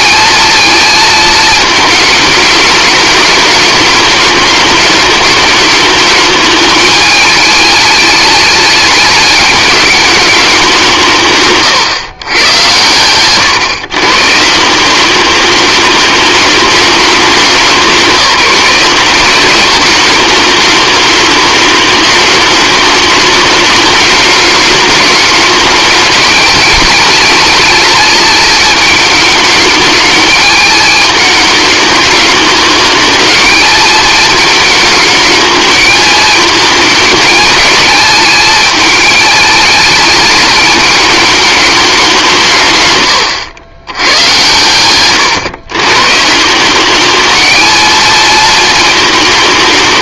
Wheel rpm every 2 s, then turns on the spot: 220, 210, 210, 220, 210, 170, 100, 180, 210, 190, 210, 210, 210, 220, 220, 210, 220, 220, 220, 220, 210, 140, 120, 200, 200.
12-14